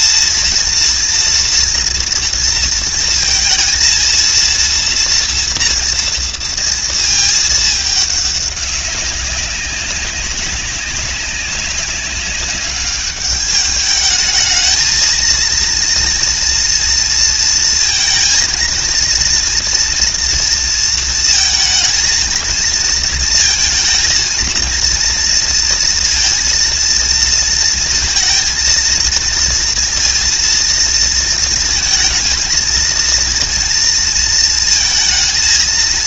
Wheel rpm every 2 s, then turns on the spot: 230, 230, 240, 230, 200, 200, 200, 220, 230, 230, 230, 230, 230, 230, 230, 230, 230, 230.
none